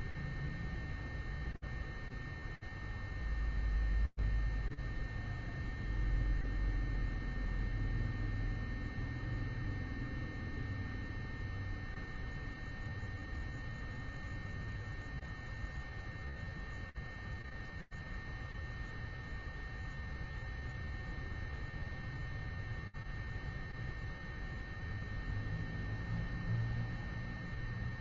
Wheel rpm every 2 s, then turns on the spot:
0, 0, 0, 0, 0, 0, 0, 0, 0, 0, 0, 0, 0, 0.
none